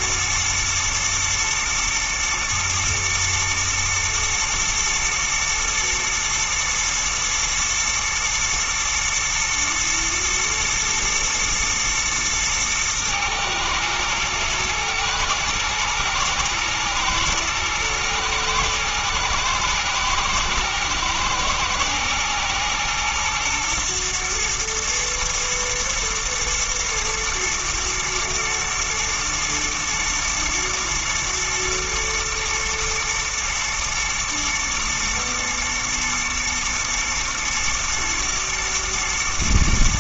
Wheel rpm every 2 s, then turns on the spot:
120, 120, 120, 120, 120, 110, 110, 110, 120, 120, 110, 110, 120, 110, 120, 110, 120, 110, 110, 120.
none